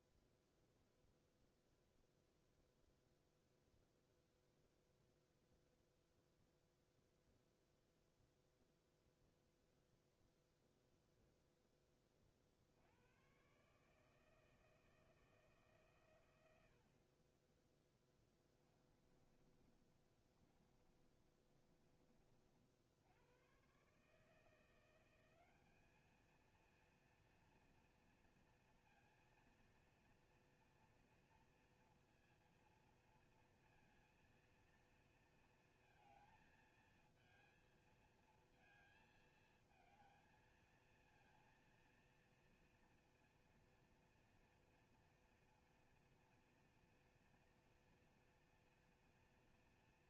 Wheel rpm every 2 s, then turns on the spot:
0, 0, 0, 0, 0, 0, 100, 160, 50, 30, 30, 80, 180, 230, 230, 240, 230, 230, 220, 230, 220, 230, 230, 230, 230.
18-22